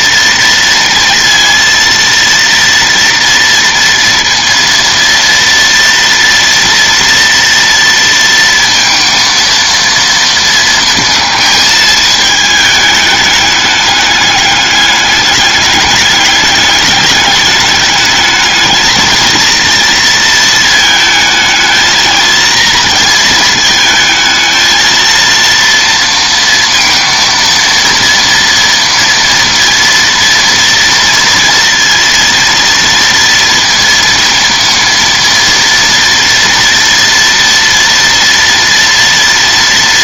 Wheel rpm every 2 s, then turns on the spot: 230, 230, 230, 230, 230, 230, 220, 200, 210, 220, 220, 230, 220, 230, 230, 230, 230, 230, 230, 240.
none